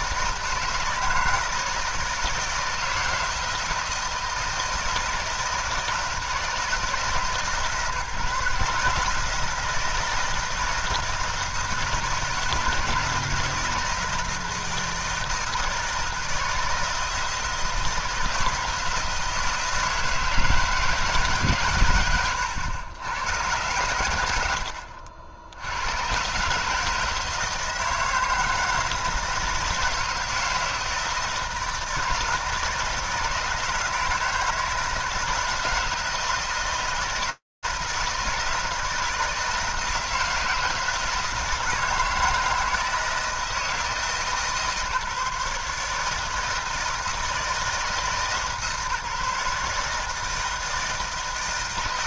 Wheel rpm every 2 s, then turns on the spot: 160, 160, 160, 160, 160, 160, 160, 160, 160, 160, 160, 110, 70, 150, 160, 160, 160, 160, 160, 160, 160, 160, 150, 160, 150, 160.
none